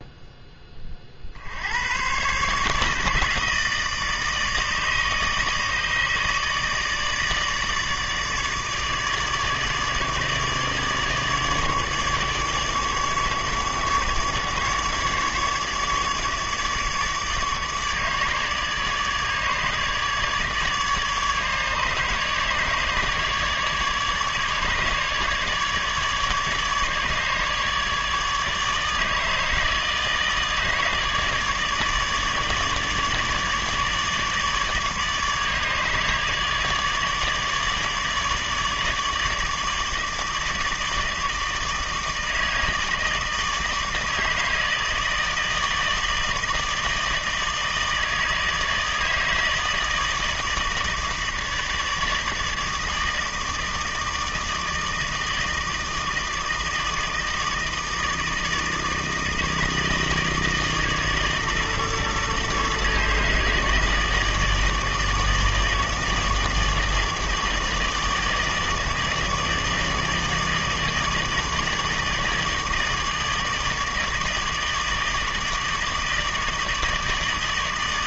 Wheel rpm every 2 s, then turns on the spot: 10, 140, 150, 150, 150, 150, 150, 150, 150, 150, 150, 150, 150, 150, 150, 150, 150, 150, 150, 150, 160, 160, 160, 160, 160, 160, 160, 160, 160, 160, 160, 150, 160, 160, 150, 150, 150, 150, 160.
none